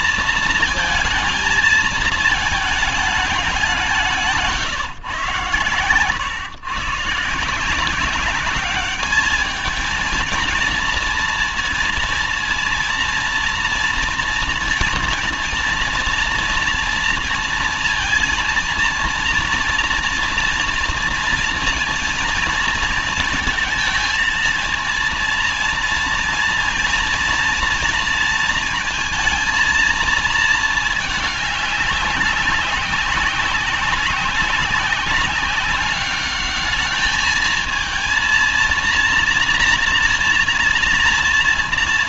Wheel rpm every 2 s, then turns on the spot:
230, 210, 160, 130, 200, 230, 230, 230, 230, 230, 230, 230, 230, 230, 230, 230, 190, 190, 210, 240, 240.
none